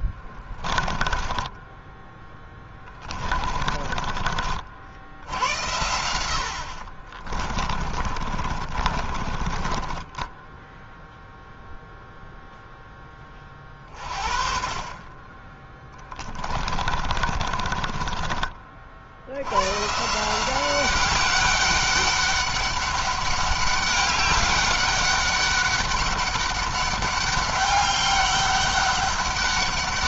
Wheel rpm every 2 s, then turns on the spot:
20, 20, 50, 70, 40, 10, 10, 40, 30, 40, 190, 200, 200, 200, 200.
0-4 6-12 16-18